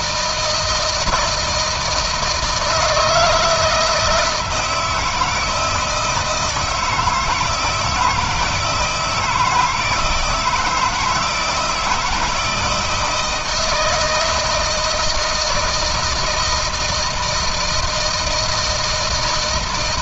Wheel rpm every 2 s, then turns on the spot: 160, 160, 160, 160, 170, 160, 170, 160, 160, 160.
none